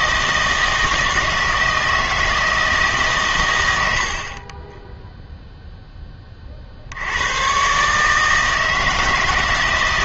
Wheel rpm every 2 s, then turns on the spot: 160, 160, 20, 60, 160.
none